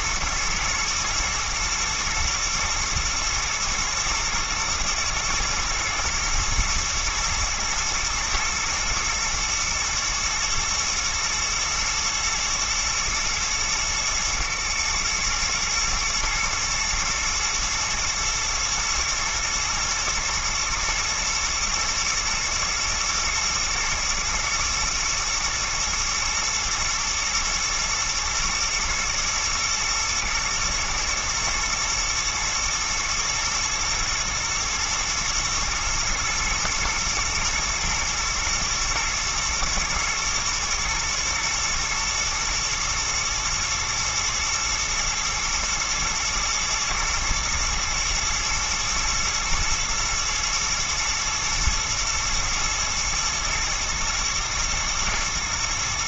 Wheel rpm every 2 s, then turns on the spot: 120, 120, 110, 110, 110, 120, 110, 120, 110, 120, 110, 110, 120, 120, 120, 120, 120, 120, 120, 110, 110, 110, 110, 120, 110, 110, 120, 110.
none